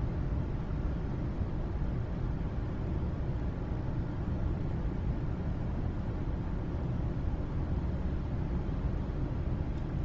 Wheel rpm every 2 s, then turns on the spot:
0, 0, 0, 0, 0.
none